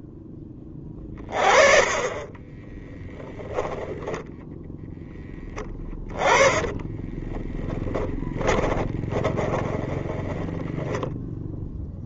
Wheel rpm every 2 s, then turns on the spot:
10, 10, 10, 10, 10, 10.
6-12